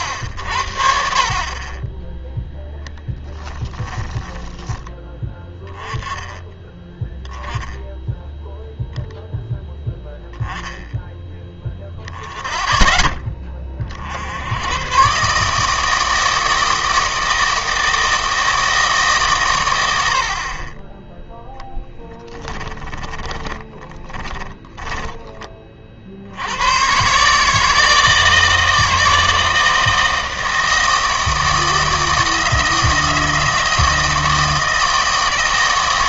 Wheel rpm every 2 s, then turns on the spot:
60, 0, 10, 10, 0, 10, 20, 100, 160, 160, 20, 20, 20, 110, 160, 160, 160, 160.
22-26